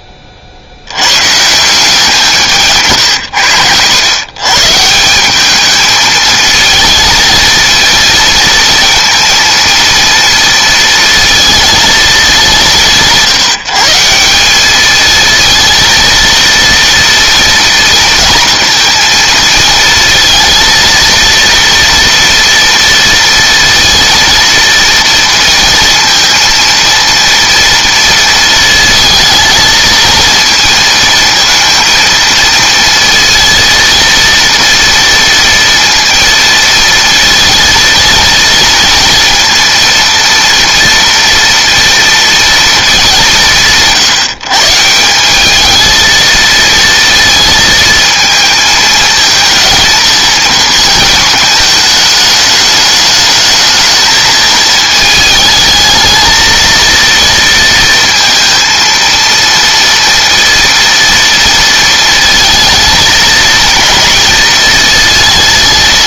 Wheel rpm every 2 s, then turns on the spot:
80, 160, 140, 220, 230, 230, 180, 210, 230, 230, 230, 230, 230, 230, 220, 230, 230, 230, 230, 230, 230, 230, 170, 230, 220, 230, 210, 220, 230, 230, 230, 230, 230.
2-4